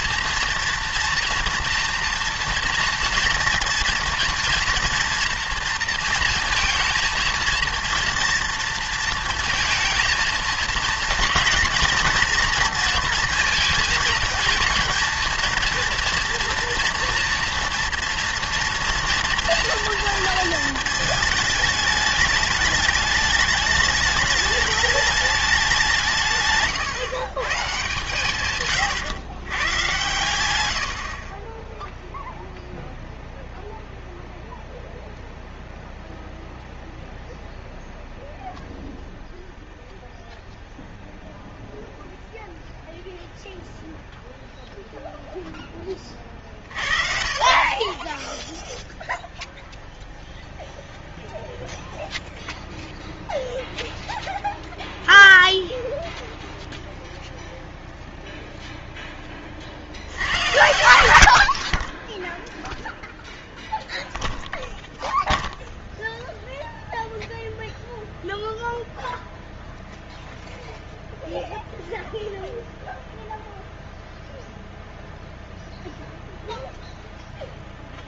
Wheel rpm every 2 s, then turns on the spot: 230, 240, 230, 220, 230, 230, 230, 230, 230, 240, 230, 210, 210, 140, 130, 100, 0, 0, 0, 0, 0, 0, 0, 40, 0, 0, 0, 0, 0, 0, 100, 0, 0, 0, 0, 0, 0, 0, 0.
26-28 30-32